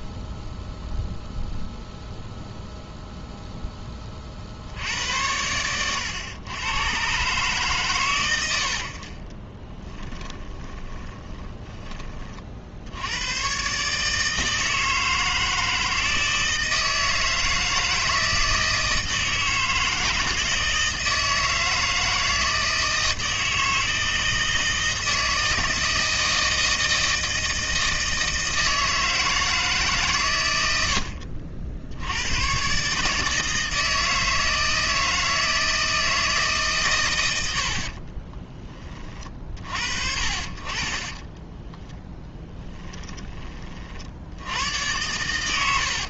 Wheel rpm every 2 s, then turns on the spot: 0, 0, 60, 100, 70, 20, 70, 160, 160, 160, 160, 160, 160, 160, 160, 90, 130, 160, 130, 20, 50, 10, 90.
10-12 42-44